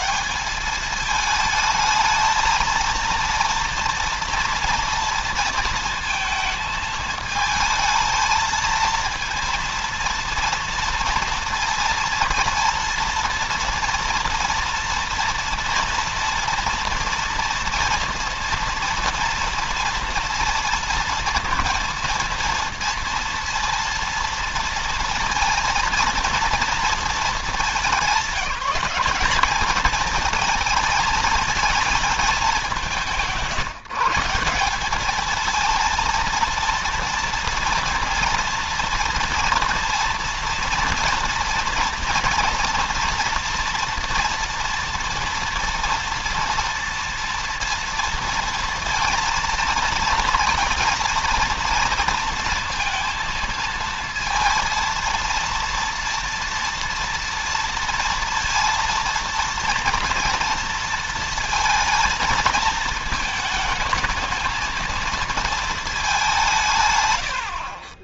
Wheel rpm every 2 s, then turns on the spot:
210, 230, 230, 220, 230, 230, 230, 230, 230, 230, 230, 230, 230, 220, 190, 220, 170, 200, 230, 240, 230, 230, 230, 230, 230, 230, 230, 230, 230, 230, 230, 220, 220, 140.
none